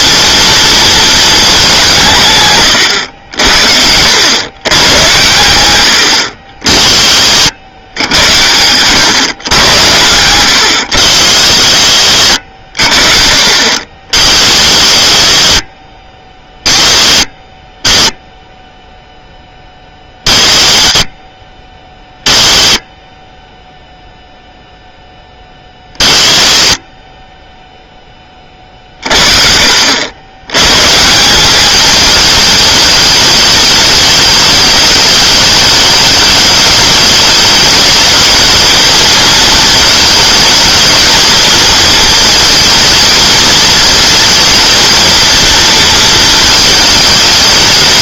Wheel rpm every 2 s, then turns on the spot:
230, 120, 110, 60, 100, 100, 60, 60, 20, 0, 30, 20, 0, 30, 40, 120, 220, 210, 210, 220, 220, 220, 230, 220.
none